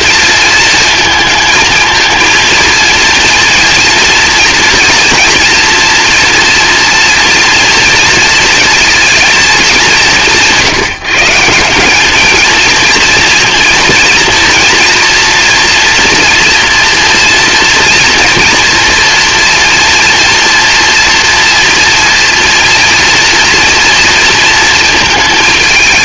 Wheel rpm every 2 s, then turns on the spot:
230, 230, 230, 230, 220, 170, 230, 240, 240, 230, 230, 230, 230.
none